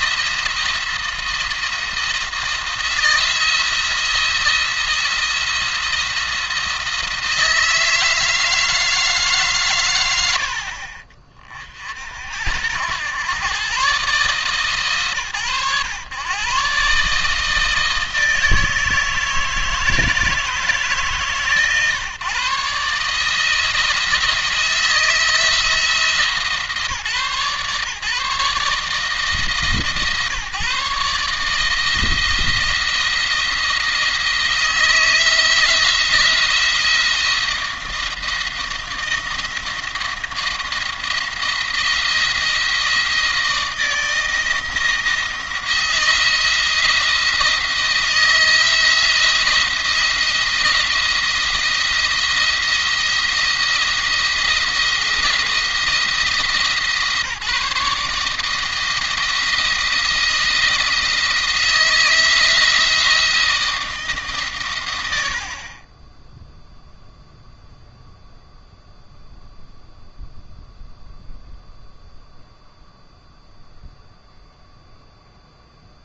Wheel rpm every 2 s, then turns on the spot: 170, 170, 170, 160, 160, 60, 90, 130, 130, 160, 150, 140, 160, 160, 160, 150, 170, 170, 170, 170, 160, 170, 170, 170, 170, 170, 170, 170, 150, 160, 160, 170, 120, 0, 0, 0, 0, 0.
none